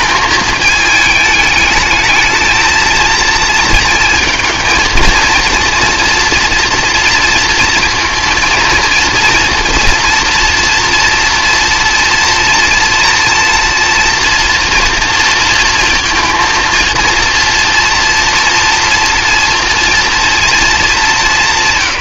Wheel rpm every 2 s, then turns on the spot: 220, 220, 230, 230, 230, 240, 230, 230, 230, 230, 220.
none